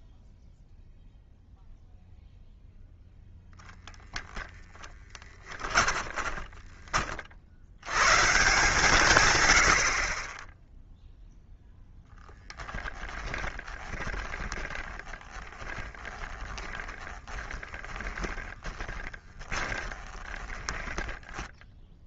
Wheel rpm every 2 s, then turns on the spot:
0, 0, 10, 30, 140, 0, 20, 30, 10, 10, 10.
4-6 12-22